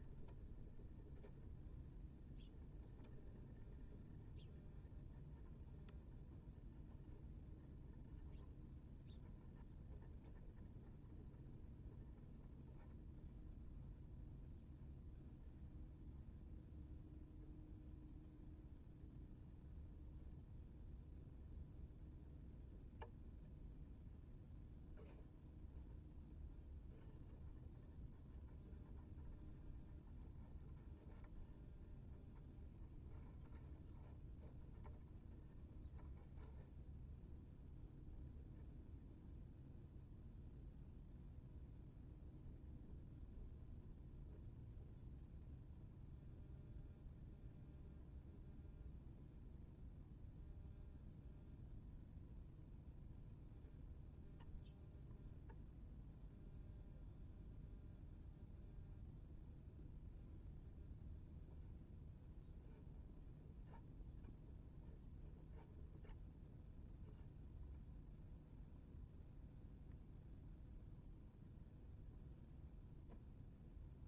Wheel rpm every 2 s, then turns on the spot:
0, 0, 0, 0, 0, 0, 0, 0, 0, 0, 0, 0, 0, 0, 0, 0, 0, 0, 0, 0, 0, 0, 0, 0, 0, 0, 0, 0, 0, 0, 0, 0, 0, 0, 0, 0, 0.
none